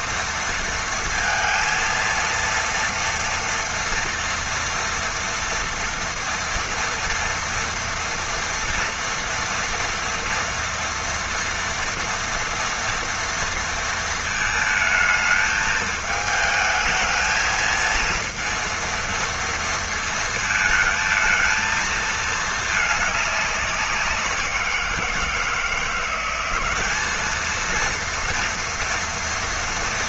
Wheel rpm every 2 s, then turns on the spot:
230, 230, 230, 240, 230, 230, 230, 220, 220, 230, 230, 220, 180, 190, 230.
none